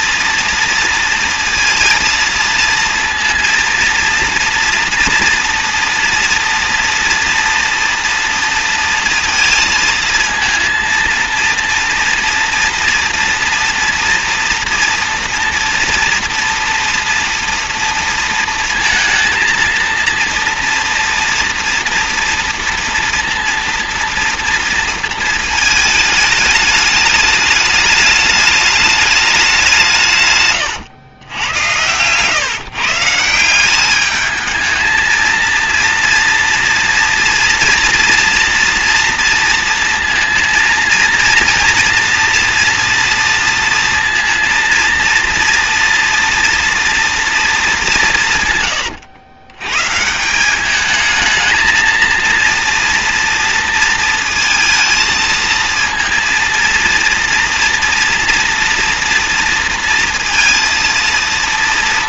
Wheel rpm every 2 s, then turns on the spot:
230, 230, 230, 230, 230, 230, 240, 230, 240, 230, 230, 230, 230, 210, 210, 110, 150, 220, 230, 240, 230, 240, 230, 230, 100, 210, 230, 230, 230, 230, 230.
none